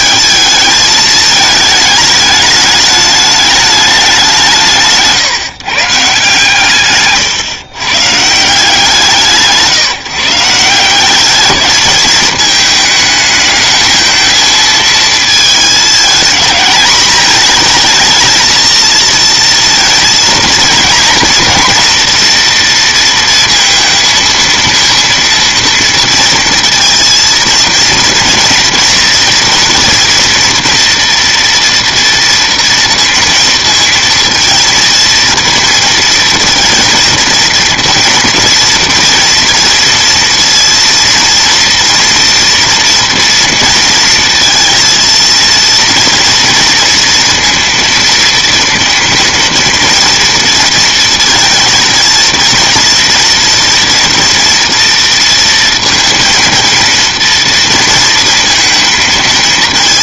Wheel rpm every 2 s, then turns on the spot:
220, 210, 170, 140, 160, 160, 220, 220, 220, 230, 230, 230, 230, 230, 230, 230, 230, 230, 220, 230, 230, 230, 230, 230, 230, 230, 230, 230, 230, 230.
none